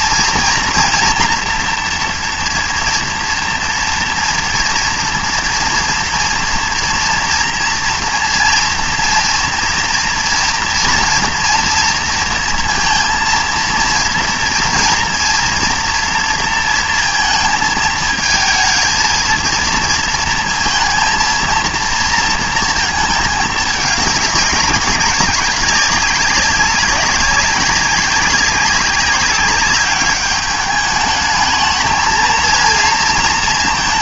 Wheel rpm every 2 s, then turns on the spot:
240, 230, 230, 230, 230, 230, 230, 230, 230, 230, 230, 230, 200, 200, 200, 210, 230.
none